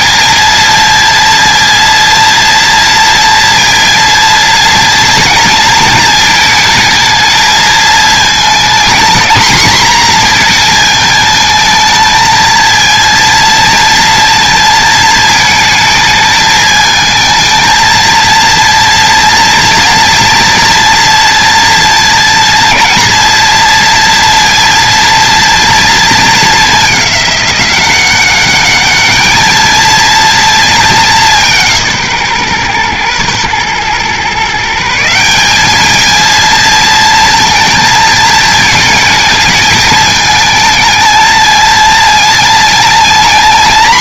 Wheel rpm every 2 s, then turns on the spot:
230, 230, 230, 220, 230, 220, 230, 230, 220, 230, 230, 230, 230, 200, 210, 200, 120, 170, 230, 220, 220, 230.
none